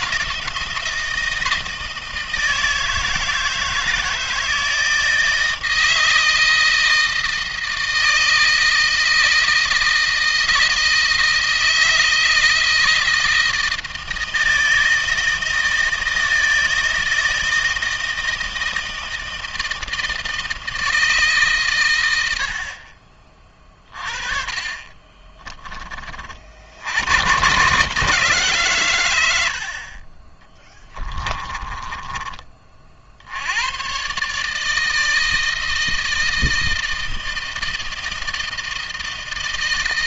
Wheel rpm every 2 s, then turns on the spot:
160, 160, 160, 160, 160, 160, 160, 160, 160, 160, 160, 30, 20, 90, 120, 20, 40, 160, 160, 160.
24-26 30-32